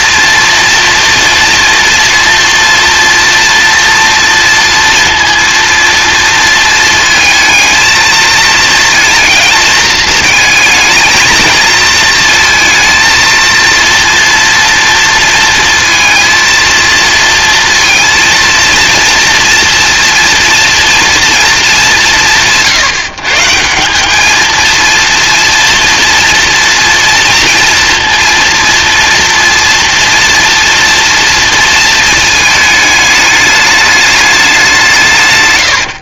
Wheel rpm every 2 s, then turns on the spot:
230, 230, 230, 220, 230, 220, 230, 230, 230, 230, 230, 160, 230, 230, 230, 230, 220, 200.
none